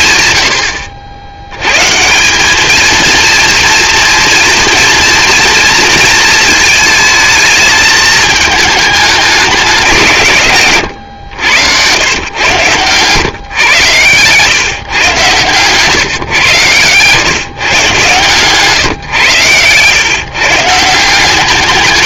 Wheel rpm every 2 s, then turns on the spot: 80, 230, 230, 220, 210, 100, 130, 130, 110, 130, 170.
none